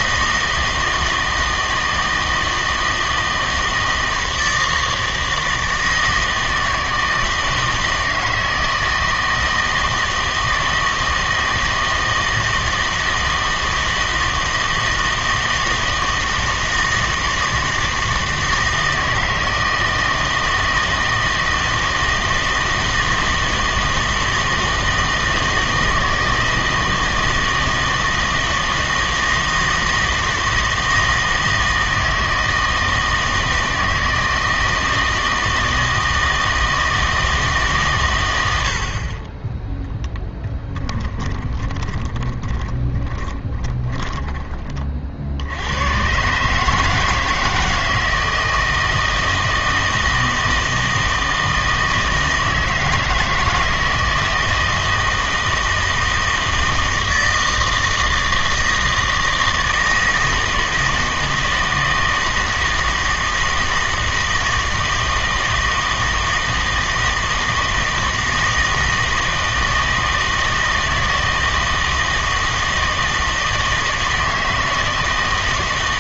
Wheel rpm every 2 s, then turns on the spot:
160, 160, 160, 160, 160, 160, 160, 160, 160, 160, 160, 160, 160, 160, 160, 160, 160, 160, 160, 80, 10, 20, 30, 150, 160, 160, 160, 160, 160, 160, 160, 160, 160, 160, 160, 160, 160, 160.
40-44